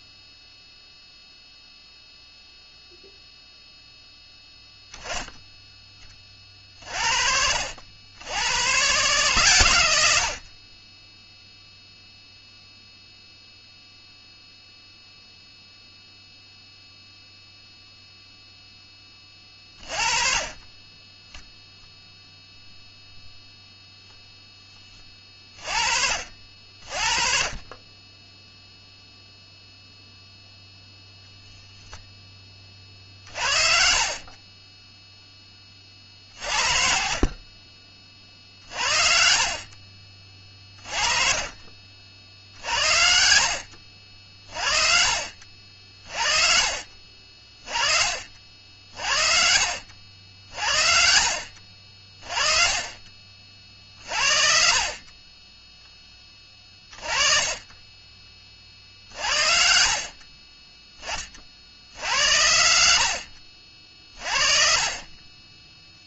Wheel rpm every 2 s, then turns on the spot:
0, 0, 0, 60, 130, 10, 0, 0, 0, 10, 10, 0, 20, 40, 0, 0, 50, 0, 50, 60, 30, 60, 50, 40, 50, 60, 40, 40, 30, 50, 20, 100, 40.
32-34 40-42 64-66